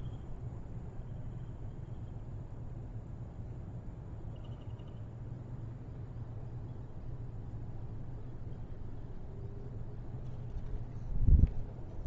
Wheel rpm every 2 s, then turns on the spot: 0, 0, 0, 0, 0, 0.
none